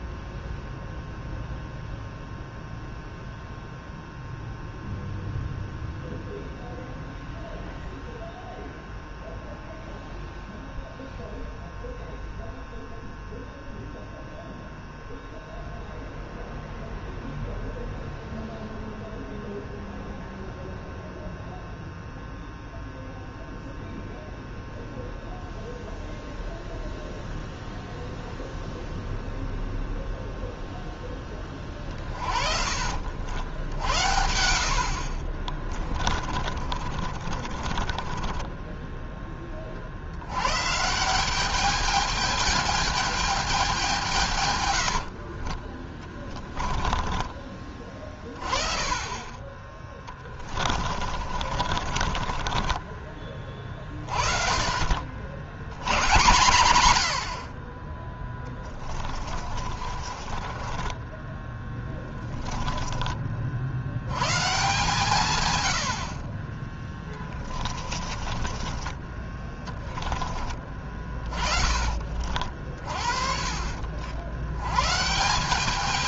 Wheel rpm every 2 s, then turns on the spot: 0, 0, 0, 0, 0, 0, 0, 0, 0, 0, 0, 0, 0, 0, 0, 0, 50, 60, 30, 10, 160, 220, 90, 30, 30, 40, 30, 40, 70, 20, 20, 20, 140, 20, 20, 30, 40, 130.
36-38 44-48 50-54 58-62 68-70